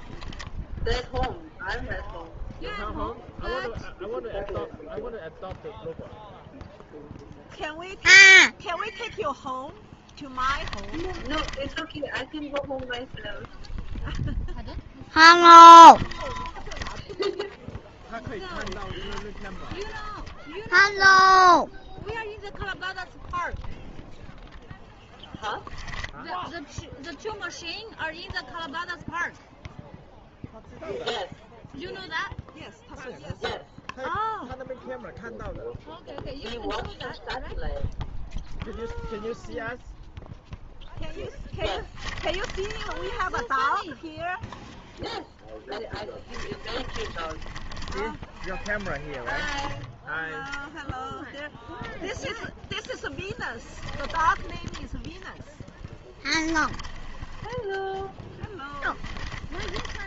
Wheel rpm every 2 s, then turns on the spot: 10, 0, 0, 0, 0, 20, 0, 0, 10, 20, 10, 0, 10, 0, 0, 0, 0, 0, 0, 0, 0, 10, 0, 20, 20, 0, 0, 10, 10, 10.
10-12 16-20 24-26 42-44 46-50 54-60